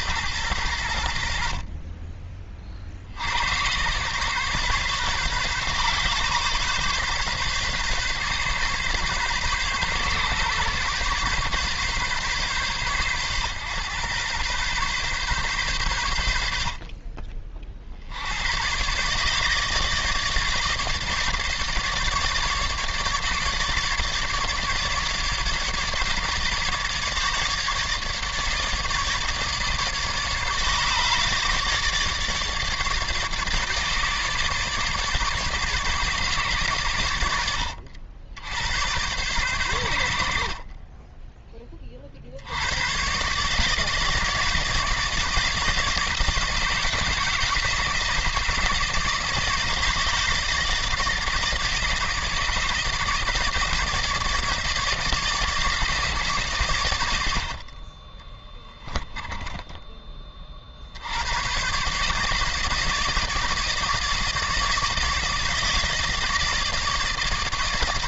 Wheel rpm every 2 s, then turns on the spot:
90, 40, 140, 130, 140, 140, 130, 130, 60, 110, 150, 150, 150, 150, 150, 150, 150, 150, 110, 90, 40, 100, 160, 160, 160, 150, 150, 160, 120, 10, 60, 160, 160, 160.
40-42 58-60